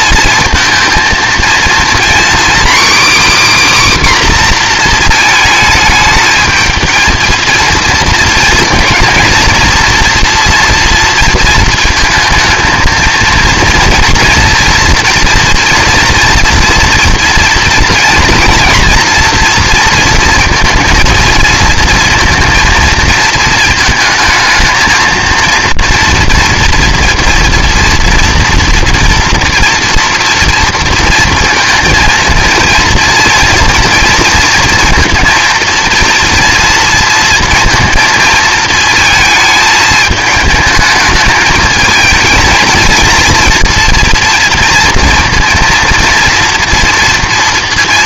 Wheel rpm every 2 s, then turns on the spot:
230, 270, 250, 220, 230, 230, 220, 230, 240, 240, 230, 230, 220, 240, 240, 230, 230, 230, 230, 220, 220, 220, 230, 230.
none